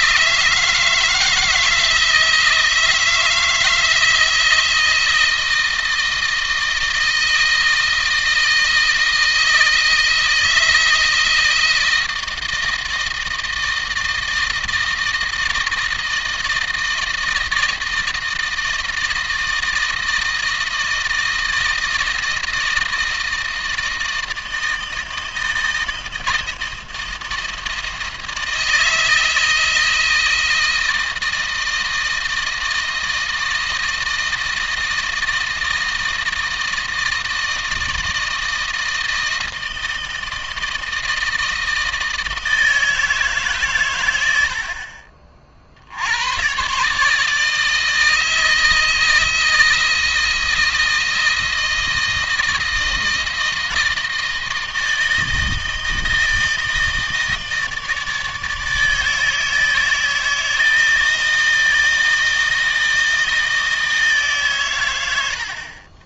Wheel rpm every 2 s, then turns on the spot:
160, 160, 160, 160, 160, 160, 160, 160, 160, 160, 160, 160, 160, 160, 160, 160, 160, 160, 160, 160, 160, 160, 50, 140, 160, 160, 160, 160, 160, 160, 160, 160, 100.
none